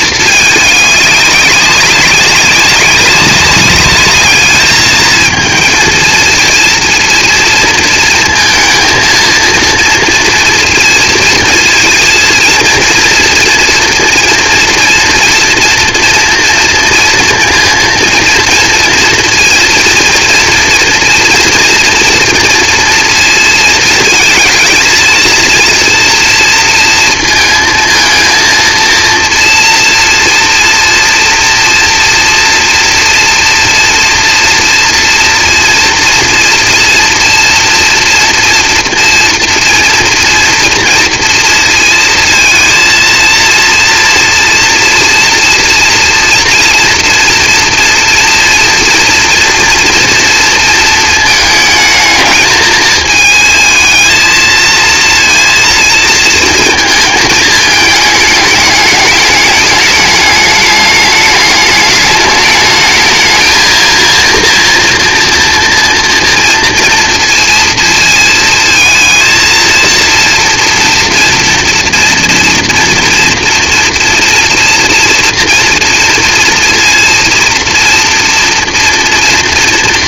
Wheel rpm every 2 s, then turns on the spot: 200, 190, 220, 230, 220, 230, 230, 230, 230, 230, 230, 230, 230, 230, 230, 230, 230, 230, 230, 240, 230, 220, 230, 230, 230, 220, 220, 230, 220, 210, 210, 220, 230, 230, 230, 230, 230, 230, 230, 230.
none